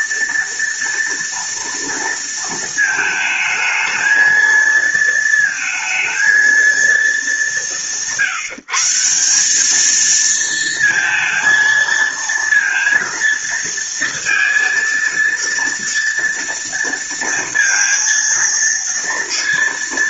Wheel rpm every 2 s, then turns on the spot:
230, 220, 230, 190, 180, 230, 230, 230, 230, 230.
none